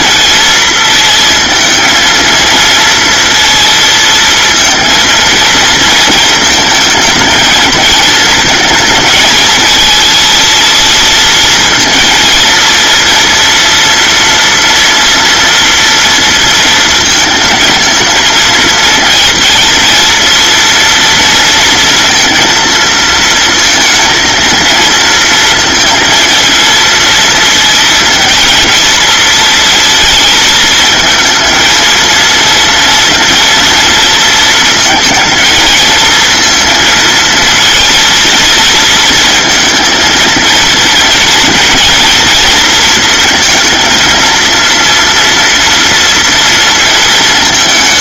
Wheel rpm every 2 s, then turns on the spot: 220, 230, 230, 220, 220, 220, 230, 230, 230, 230, 230, 230, 220, 230, 220, 220, 230, 220, 230, 230, 230, 230, 230, 220.
none